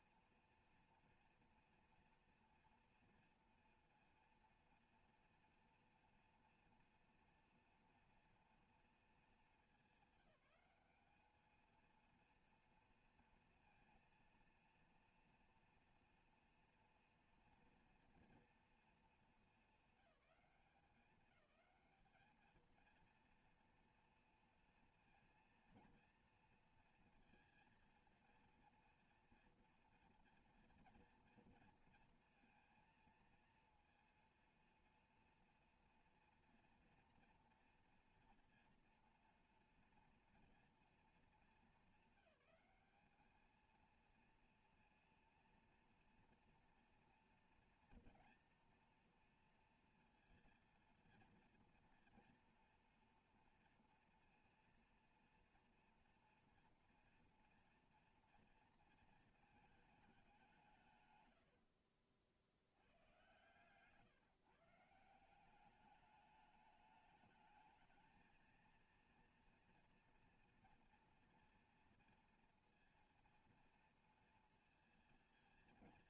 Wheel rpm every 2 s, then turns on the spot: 230, 230, 230, 240, 240, 200, 230, 230, 240, 230, 190, 220, 230, 230, 230, 230, 230, 240, 240, 230, 230, 210, 230, 240, 230, 230, 230, 230, 230, 230, 180, 80, 150, 210, 230, 230, 230, 230.
none